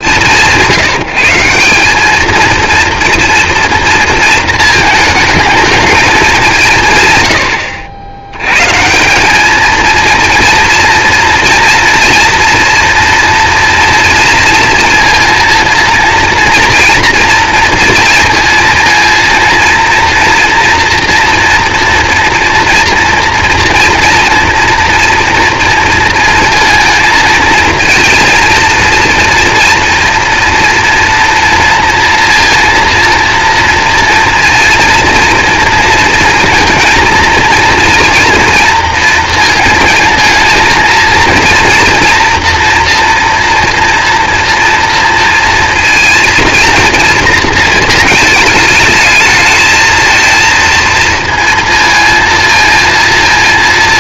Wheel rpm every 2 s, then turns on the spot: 180, 230, 220, 140, 150, 230, 230, 230, 230, 230, 230, 230, 230, 230, 230, 240, 230, 230, 230, 230, 220, 240, 230, 230, 210, 230, 230.
none